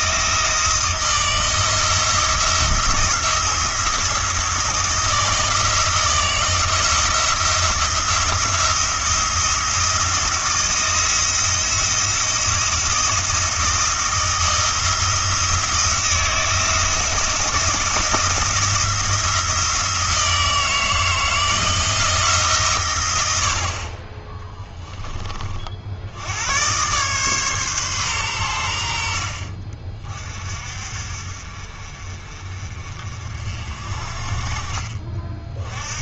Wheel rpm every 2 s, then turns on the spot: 170, 170, 170, 170, 170, 170, 170, 170, 170, 170, 160, 120, 10, 120, 90, 50, 40, 40.
none